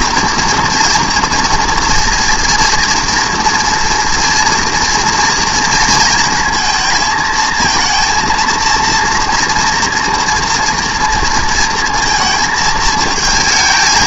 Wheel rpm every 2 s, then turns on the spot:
240, 230, 230, 220, 230, 230, 220.
none